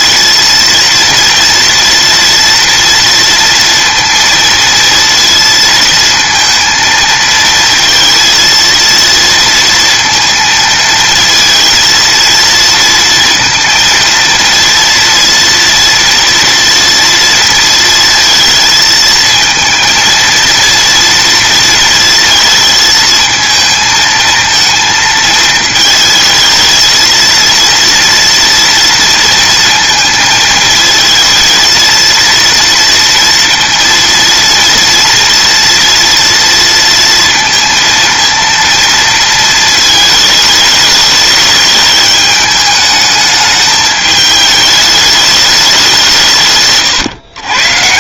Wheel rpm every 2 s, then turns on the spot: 230, 230, 230, 230, 230, 220, 230, 230, 230, 220, 230, 220, 220, 230, 230, 220, 230, 230, 230, 230, 210, 210, 210, 130.
none